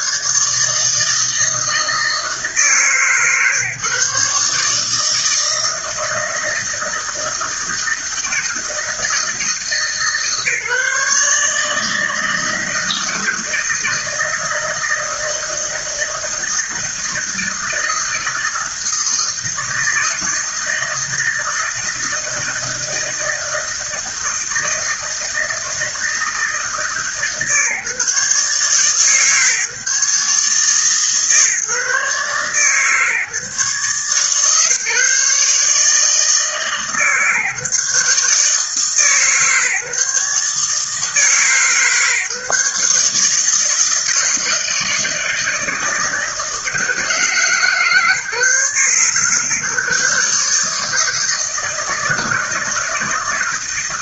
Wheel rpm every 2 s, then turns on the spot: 160, 150, 160, 160, 160, 150, 160, 160, 160, 160, 160, 160, 160, 150, 140, 150, 140, 150, 150, 150, 150, 150, 160, 160, 130, 160, 160.
none